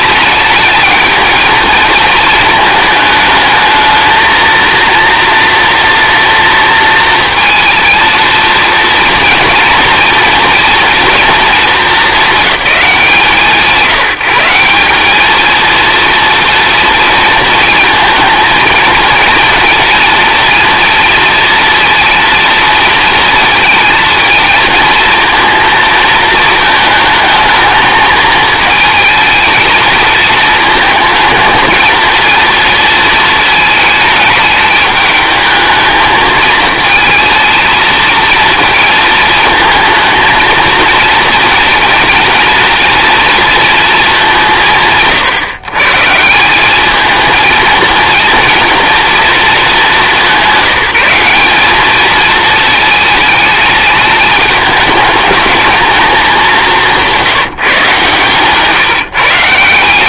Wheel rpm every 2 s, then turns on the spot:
220, 220, 230, 230, 240, 230, 200, 190, 230, 230, 240, 230, 230, 220, 220, 220, 230, 210, 220, 220, 230, 230, 170, 210, 230, 200, 220, 210, 180, 150.
none